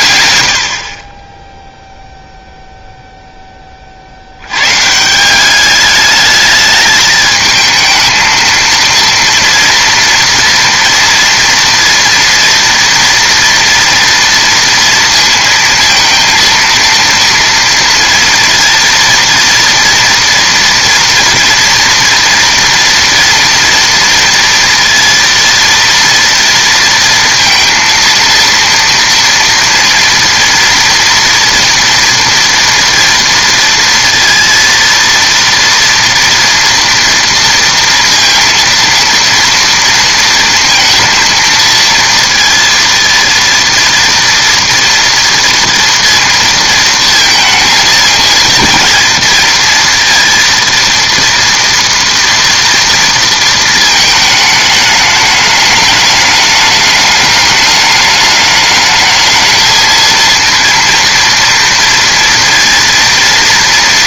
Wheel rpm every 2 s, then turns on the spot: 70, 0, 120, 210, 230, 230, 230, 230, 230, 230, 240, 230, 230, 230, 230, 230, 230, 230, 230, 230, 230, 230, 230, 230, 230, 230, 230, 210, 210, 210, 230, 230.
none